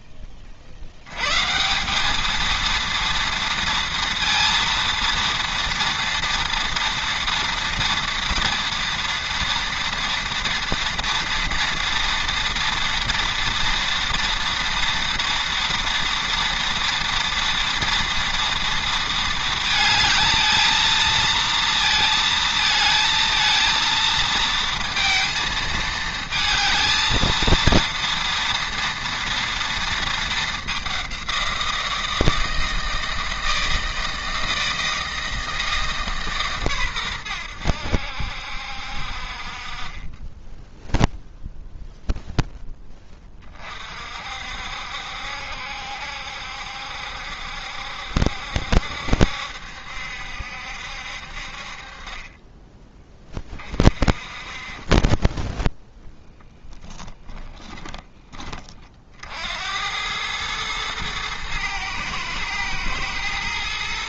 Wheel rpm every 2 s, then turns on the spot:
40, 230, 230, 230, 230, 230, 230, 240, 230, 230, 220, 220, 230, 220, 230, 200, 160, 160, 130, 60, 10, 10, 60, 70, 70, 70, 20, 40, 10, 30, 110, 110.
none